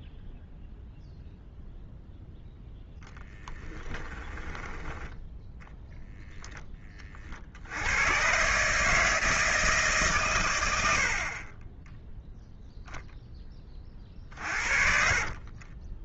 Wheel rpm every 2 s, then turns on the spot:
0, 10, 10, 20, 150, 80, 0, 50.
2-6 14-16